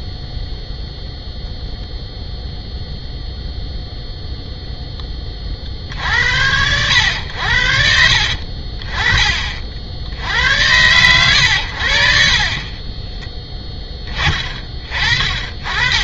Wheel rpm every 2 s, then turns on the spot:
0, 0, 0, 90, 40, 100, 20, 30.
none